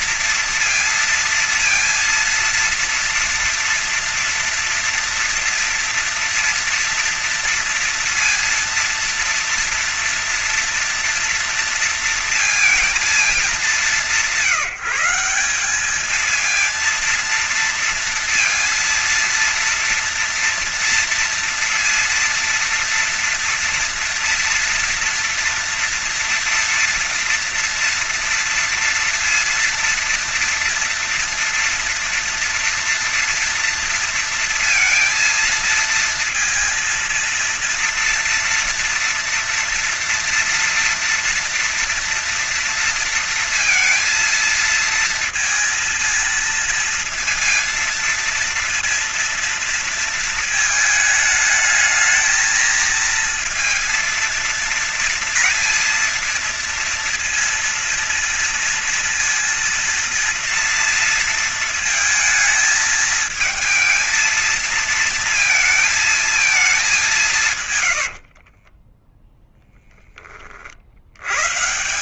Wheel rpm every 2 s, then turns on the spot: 230, 230, 230, 230, 230, 230, 230, 160, 220, 230, 230, 230, 230, 230, 230, 230, 230, 230, 230, 230, 230, 230, 230, 230, 230, 220, 220, 230, 230, 230, 230, 220, 230, 220, 70, 30.
68-70